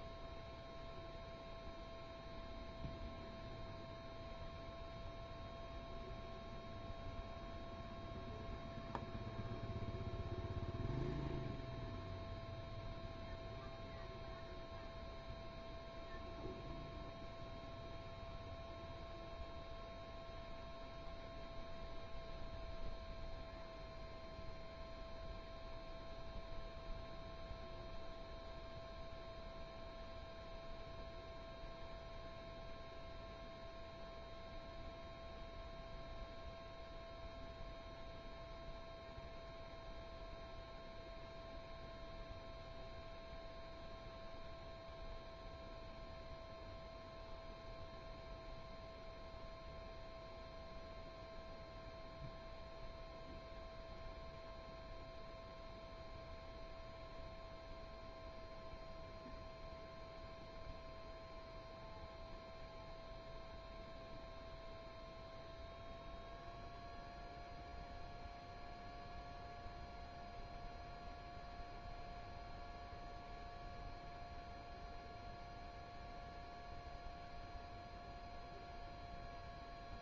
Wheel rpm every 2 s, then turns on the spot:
0, 0, 0, 0, 0, 0, 0, 0, 0, 0, 0, 0, 0, 0, 0, 0, 0, 0, 0, 0, 0, 0, 0, 0, 0, 0, 0, 0, 0, 0, 0, 0, 0, 0, 0, 0, 0, 0, 0, 0.
none